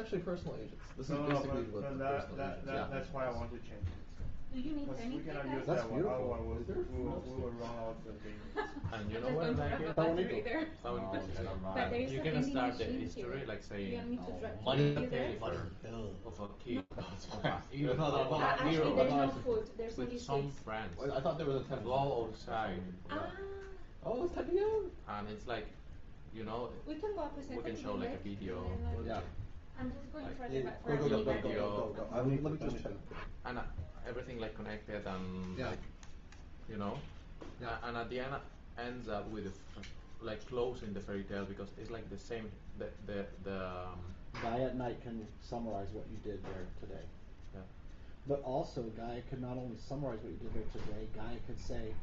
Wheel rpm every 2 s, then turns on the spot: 0, 0, 0, 0, 0, 0, 0, 0, 0, 0, 0, 0, 0, 0, 0, 0, 0, 0, 0, 0, 0, 0, 0, 0, 0, 0.
none